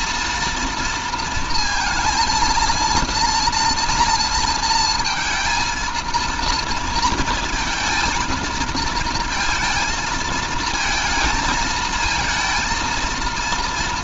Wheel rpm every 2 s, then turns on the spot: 230, 230, 230, 230, 220, 220, 230.
none